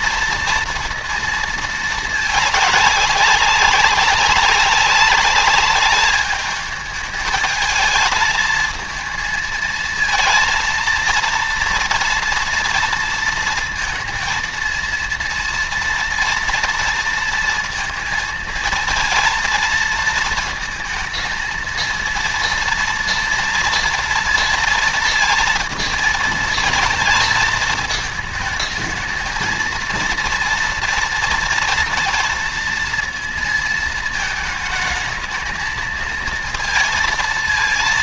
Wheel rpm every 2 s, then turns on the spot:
230, 200, 200, 220, 230, 230, 230, 230, 230, 230, 230, 230, 230, 220, 220, 230, 230, 220, 230.
none